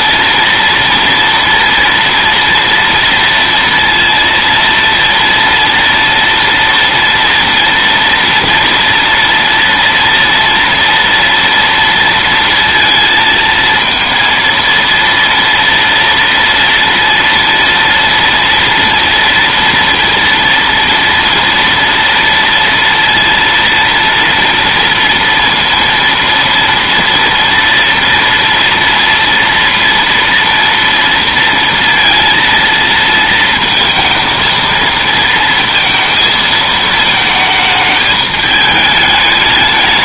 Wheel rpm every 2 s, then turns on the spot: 230, 230, 230, 230, 240, 230, 230, 230, 230, 230, 230, 230, 230, 230, 230, 230, 230, 230, 220, 210.
none